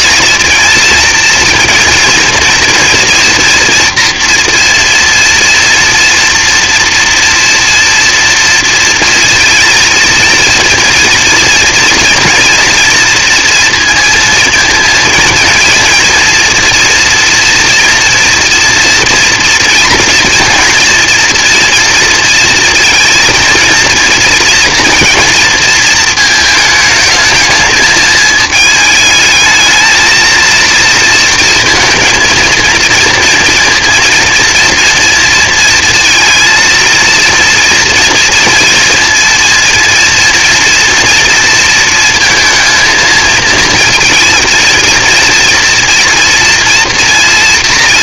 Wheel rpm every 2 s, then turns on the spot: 230, 230, 230, 230, 230, 230, 230, 230, 240, 230, 230, 230, 230, 220, 220, 230, 230, 230, 230, 230, 230, 230, 230, 230.
none